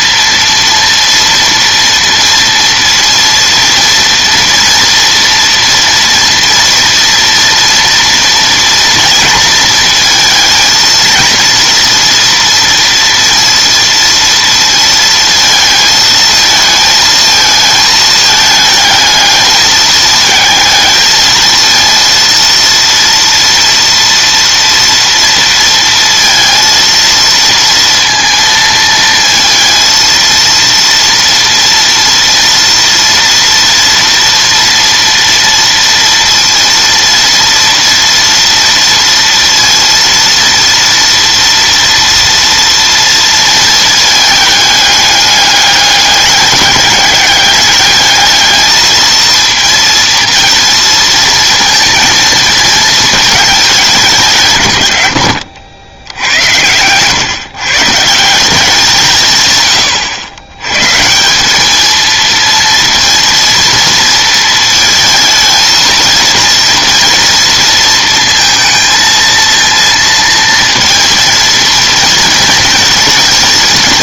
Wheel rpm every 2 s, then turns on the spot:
230, 230, 230, 230, 230, 220, 230, 230, 220, 220, 220, 230, 230, 230, 230, 230, 230, 230, 230, 230, 230, 230, 220, 210, 220, 230, 220, 140, 90, 180, 120, 230, 220, 230, 230, 230, 230.
none